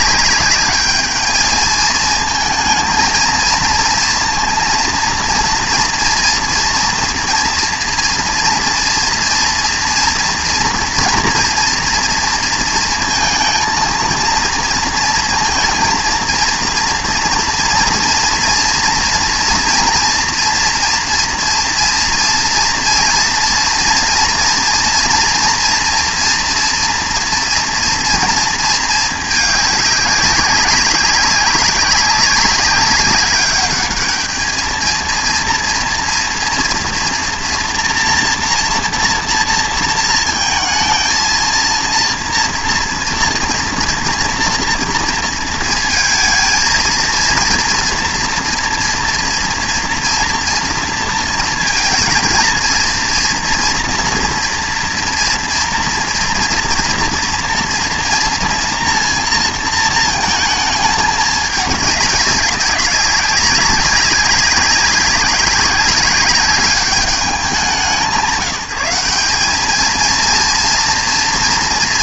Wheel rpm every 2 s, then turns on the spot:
210, 220, 230, 230, 230, 230, 230, 230, 230, 230, 240, 230, 240, 230, 230, 200, 200, 220, 240, 240, 230, 230, 230, 220, 230, 230, 230, 240, 230, 240, 220, 200, 200, 200, 170, 230.
none